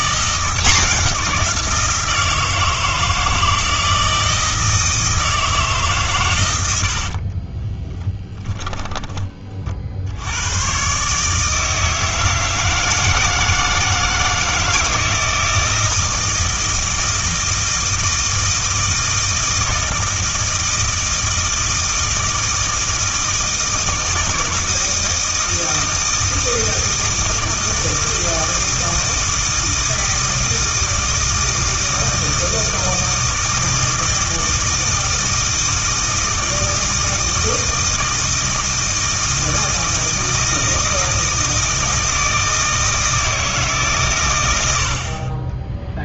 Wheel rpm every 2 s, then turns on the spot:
180, 170, 160, 80, 20, 120, 160, 160, 160, 160, 160, 160, 160, 160, 160, 160, 160, 160, 160, 160, 160, 160, 70.
6-10